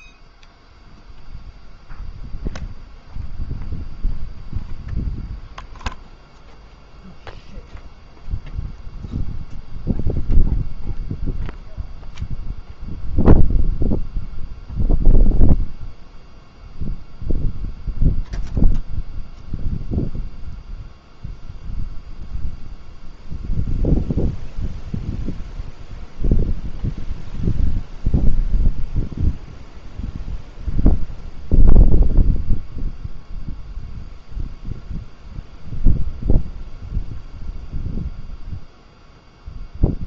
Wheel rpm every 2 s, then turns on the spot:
0, 0, 0, 0, 0, 0, 0, 0, 0, 0, 0, 0, 0, 0, 0, 0, 0, 0, 0, 0.
none